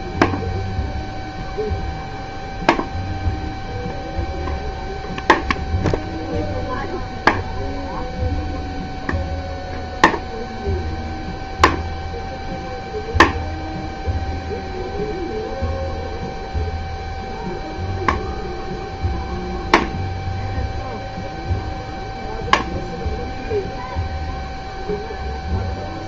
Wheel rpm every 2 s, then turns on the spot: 0, 0, 0, 0, 0, 0, 0, 0, 0, 0, 0, 0, 0.
none